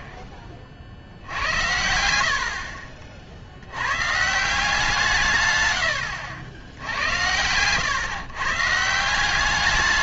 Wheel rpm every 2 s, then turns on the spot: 30, 50, 160, 80, 150.
none